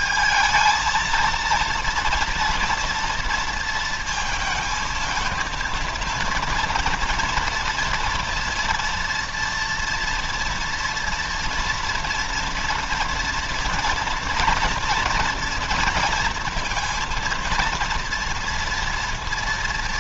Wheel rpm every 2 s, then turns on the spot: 220, 230, 220, 230, 230, 230, 230, 230, 230, 230.
none